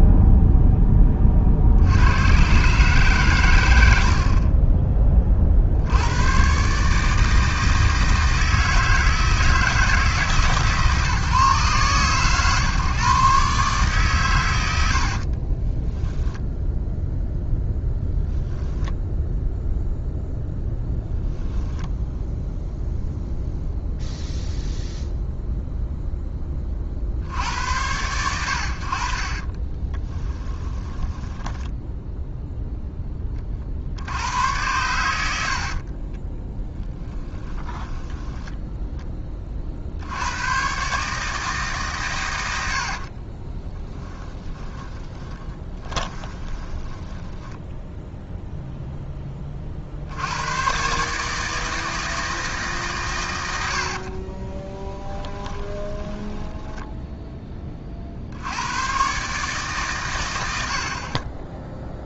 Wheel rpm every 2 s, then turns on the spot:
10, 140, 30, 150, 160, 150, 130, 70, 0, 10, 0, 0, 0, 40, 60, 10, 10, 100, 10, 10, 140, 60, 10, 20, 0, 130, 140, 10, 10, 110, 80.
14-16 30-32 36-38 42-48 54-58